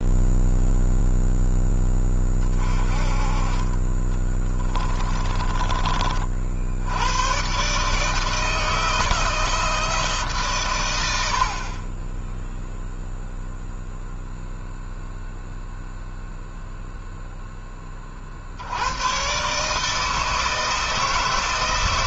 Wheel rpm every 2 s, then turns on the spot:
0, 30, 20, 100, 160, 100, 0, 0, 0, 110, 160.
4-6